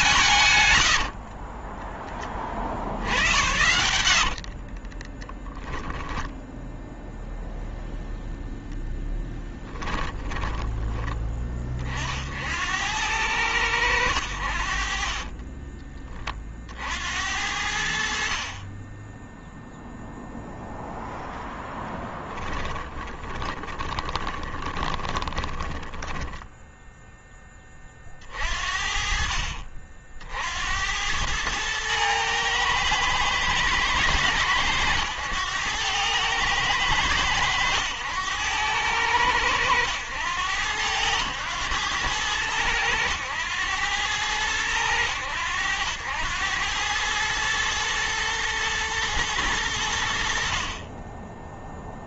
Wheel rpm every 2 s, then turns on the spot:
60, 70, 20, 0, 0, 20, 90, 30, 80, 10, 0, 20, 10, 10, 50, 90, 110, 100, 110, 90, 90, 100, 90, 110, 110, 20.
0-6 14-16 22-26